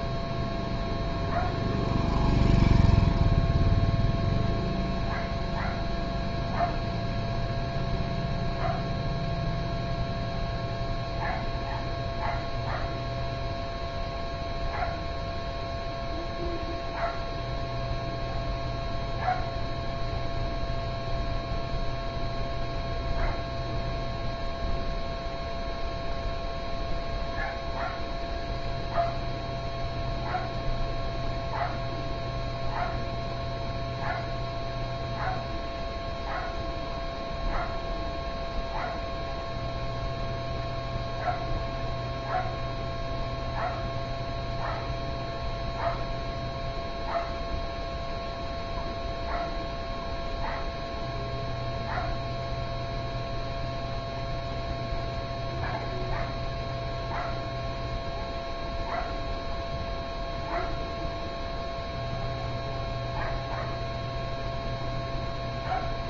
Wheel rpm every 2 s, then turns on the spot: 0, 0, 0, 0, 0, 0, 0, 0, 0, 0, 0, 0, 0, 0, 0, 0, 0, 0, 0, 0, 0, 0, 0, 0, 0, 0, 0, 0, 0, 0, 0, 0, 0.
none